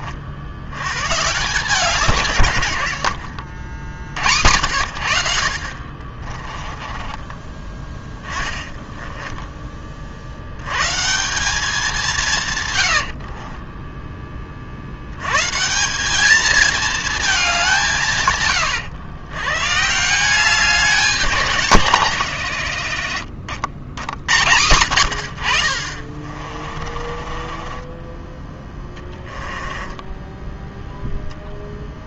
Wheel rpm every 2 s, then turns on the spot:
110, 70, 70, 20, 10, 130, 100, 60, 220, 110, 180, 90, 100, 30, 20, 0.
6-10 12-14 26-30